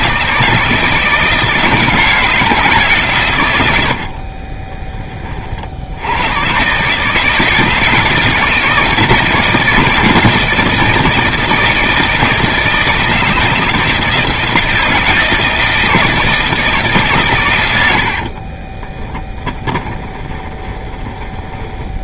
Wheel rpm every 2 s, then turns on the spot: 160, 150, 20, 140, 160, 160, 160, 160, 150, 20, 20.
4-6 18-22